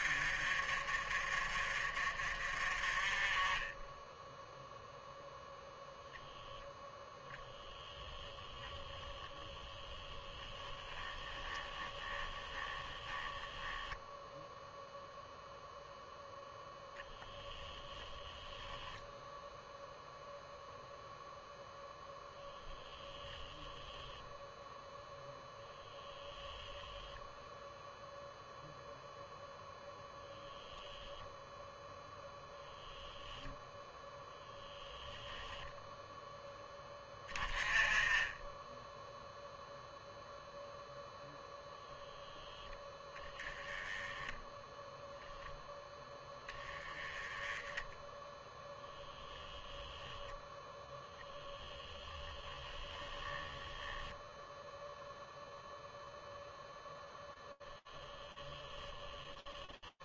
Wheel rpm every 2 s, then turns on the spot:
50, 30, 0, 10, 30, 10, 10, 0, 0, 0, 0, 0, 0, 10, 0, 10, 0, 0, 10, 10, 0, 0, 10, 10, 10, 0, 10, 0, 0, 10.
6-14 48-50 52-54